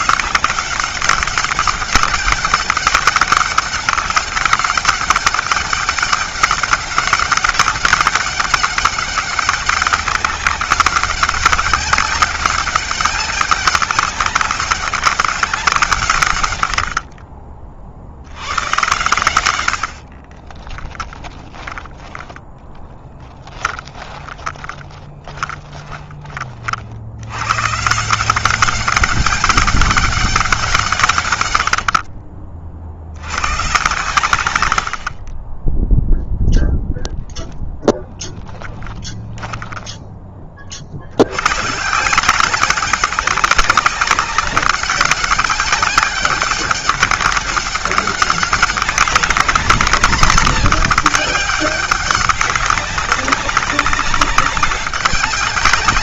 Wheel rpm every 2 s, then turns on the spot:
190, 190, 200, 200, 200, 190, 200, 200, 60, 110, 10, 10, 20, 70, 190, 140, 70, 60, 0, 20, 70, 190, 200, 190, 200, 210, 200, 190.
16-18 20-26 38-40